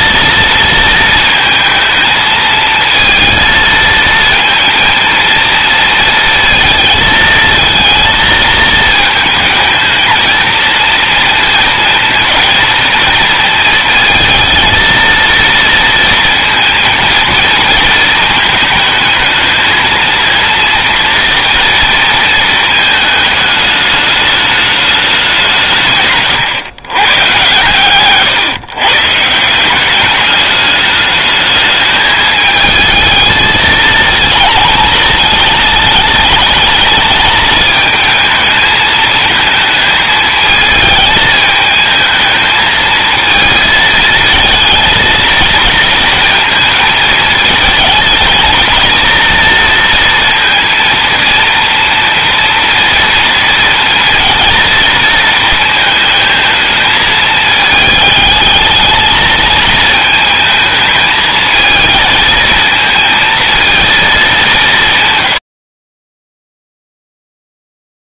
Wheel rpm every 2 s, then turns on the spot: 220, 230, 230, 220, 220, 230, 220, 230, 230, 220, 230, 220, 210, 130, 140, 210, 220, 220, 210, 220, 220, 220, 220, 220, 220, 230, 230, 230, 220, 220, 220, 230, 160, 0.
none